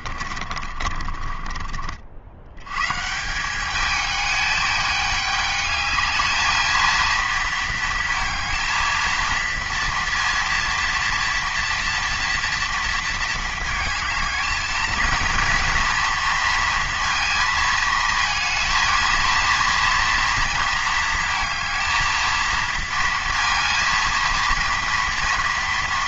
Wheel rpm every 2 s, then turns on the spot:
30, 100, 210, 220, 230, 230, 230, 220, 230, 230, 230, 230, 230.
0-2